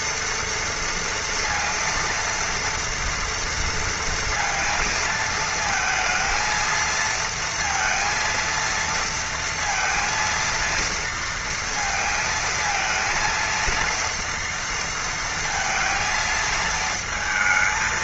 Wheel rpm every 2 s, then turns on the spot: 230, 230, 230, 230, 230, 230, 230, 230, 220.
none